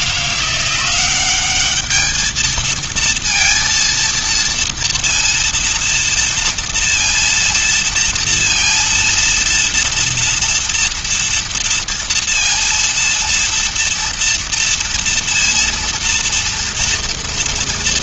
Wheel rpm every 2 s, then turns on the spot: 180, 220, 230, 230, 230, 230, 230, 230, 230.
none